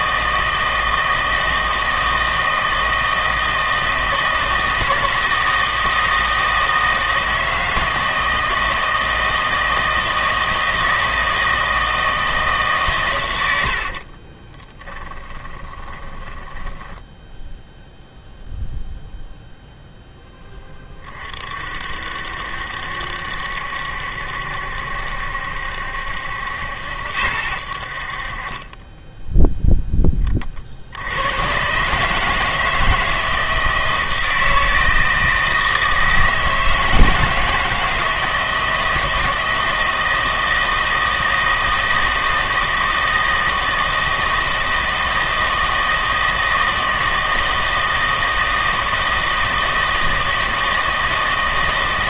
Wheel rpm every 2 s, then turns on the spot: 160, 160, 160, 160, 160, 160, 130, 30, 10, 0, 20, 70, 70, 80, 20, 60, 160, 160, 160, 160, 160, 160, 160, 160, 160, 160.
14-18